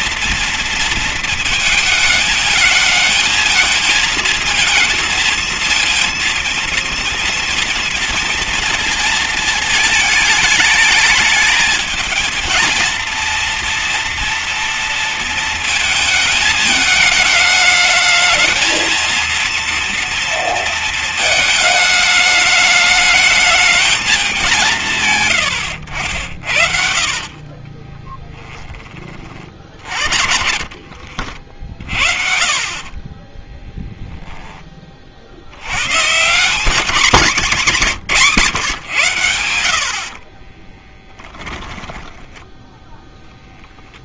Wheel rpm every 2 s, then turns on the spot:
230, 220, 220, 230, 230, 210, 220, 230, 220, 220, 230, 210, 190, 60, 20, 70, 30, 10, 150, 140, 50, 10.
26-28 30-32 40-44